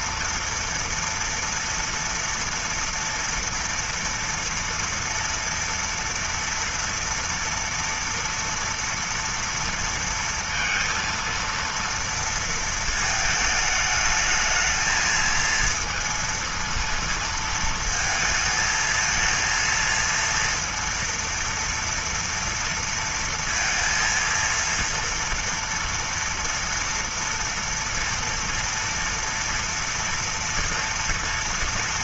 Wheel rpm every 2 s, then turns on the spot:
230, 230, 240, 230, 230, 230, 220, 220, 230, 220, 230, 230, 230, 230, 230, 230.
none